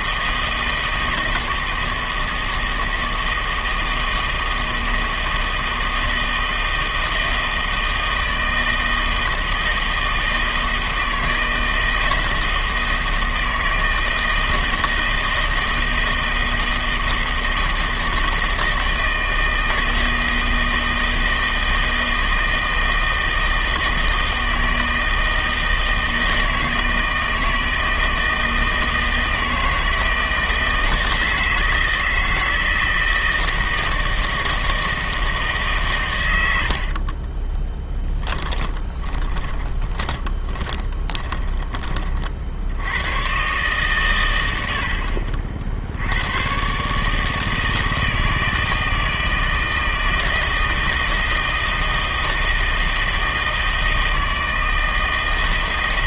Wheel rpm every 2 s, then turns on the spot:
160, 160, 160, 160, 160, 160, 160, 160, 160, 160, 160, 160, 160, 160, 160, 160, 160, 160, 70, 20, 20, 80, 70, 140, 160, 160, 160, 160.
36-42